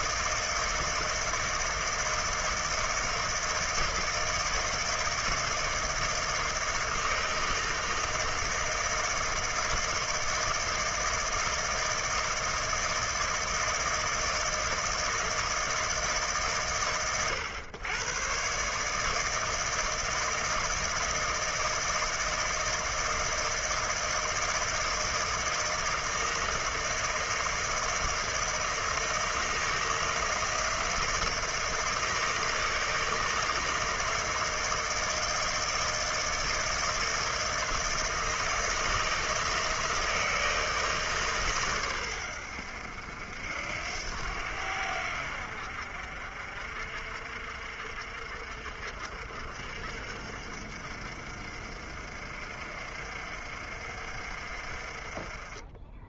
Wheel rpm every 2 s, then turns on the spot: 160, 160, 160, 160, 160, 160, 160, 160, 120, 160, 160, 160, 160, 160, 160, 160, 160, 160, 160, 160, 150, 70, 70, 50, 60, 60, 60, 30.
none